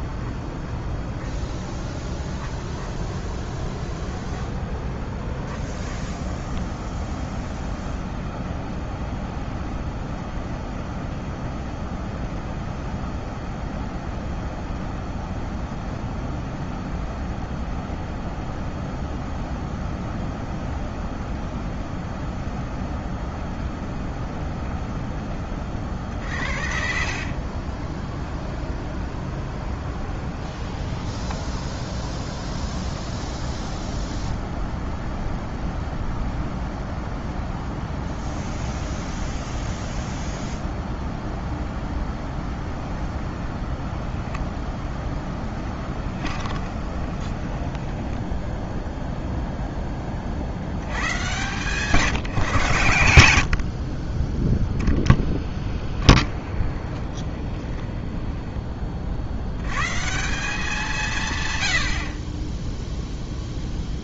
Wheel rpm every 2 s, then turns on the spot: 20, 10, 20, 20, 10, 10, 10, 10, 10, 20, 10, 10, 10, 40, 20, 20, 10, 0, 0, 0, 0, 0, 0, 20, 0, 70, 140, 10, 20, 20, 180, 10.
0-8 26-34 46-48 56-58